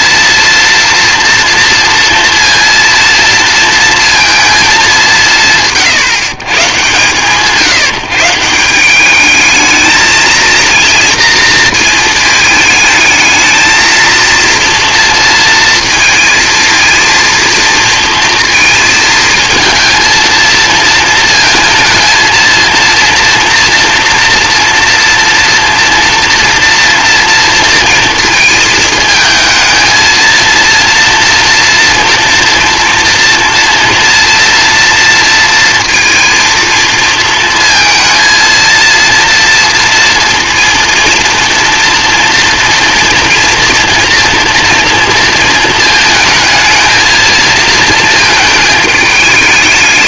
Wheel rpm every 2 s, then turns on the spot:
230, 230, 210, 140, 170, 230, 220, 230, 230, 220, 220, 230, 240, 230, 220, 230, 230, 230, 230, 230, 230, 230, 230, 220, 220.
none